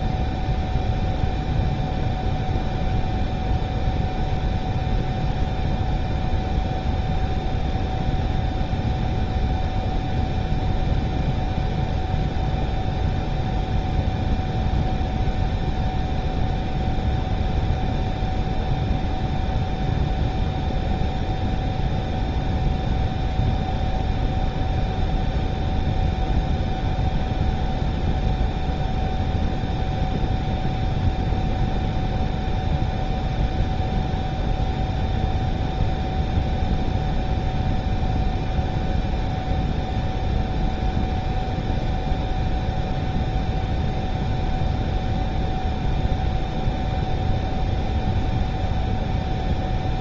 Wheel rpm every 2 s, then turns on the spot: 0, 0, 0, 0, 0, 0, 0, 0, 0, 0, 0, 0, 0, 0, 0, 0, 0, 0, 0, 0, 0, 0, 0, 0, 0.
none